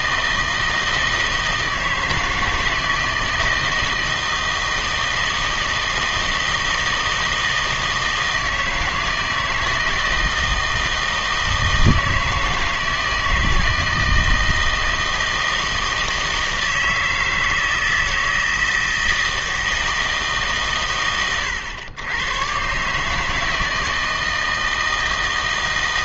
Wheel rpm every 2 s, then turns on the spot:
160, 160, 160, 160, 160, 160, 160, 160, 160, 160, 130, 130, 160.
none